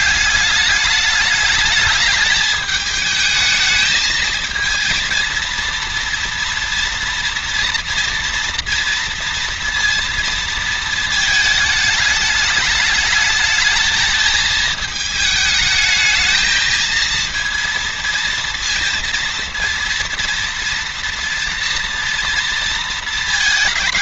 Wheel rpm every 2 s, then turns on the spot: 210, 220, 220, 230, 230, 220, 210, 220, 220, 230, 240, 230.
none